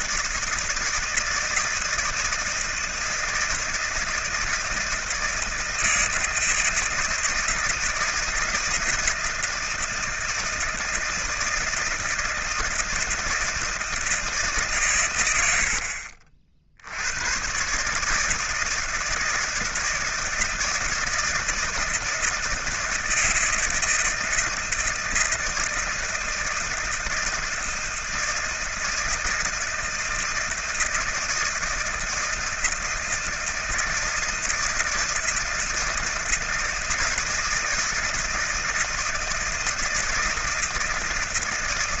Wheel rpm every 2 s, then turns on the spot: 160, 160, 160, 160, 170, 160, 160, 140, 70, 160, 160, 160, 160, 160, 160, 160, 160, 160, 160, 160, 160.
none